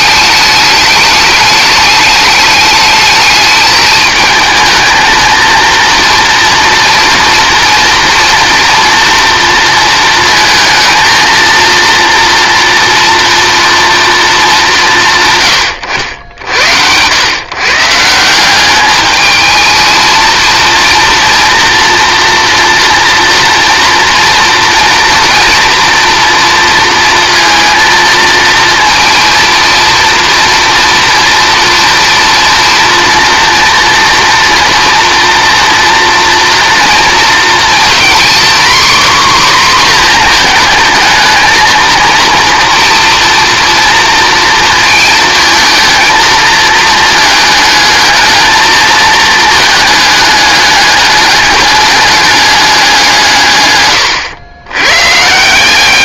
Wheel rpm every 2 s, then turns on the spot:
210, 210, 220, 240, 240, 220, 230, 200, 80, 190, 230, 240, 230, 230, 230, 230, 230, 230, 230, 260, 220, 230, 230, 220, 220, 210, 200, 110.
none